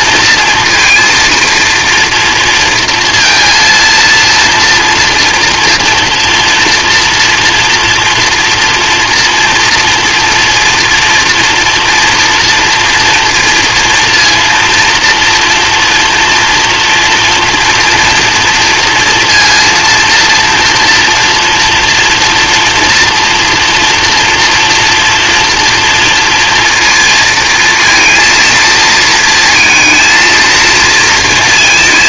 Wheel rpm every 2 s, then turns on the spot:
230, 230, 230, 230, 230, 240, 230, 230, 230, 230, 230, 230, 230, 230, 230, 230.
none